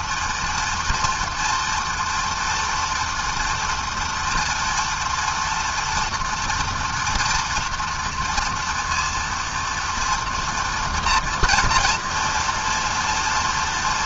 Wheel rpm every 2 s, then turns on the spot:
230, 240, 240, 230, 230, 230, 230.
none